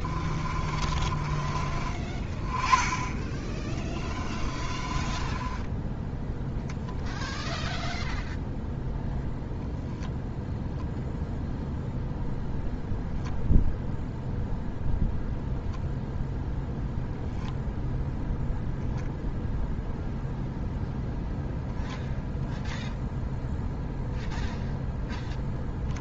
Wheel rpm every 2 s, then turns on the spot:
30, 20, 30, 0, 0, 0, 0, 0, 0, 0, 0, 0, 0.
0-2 4-6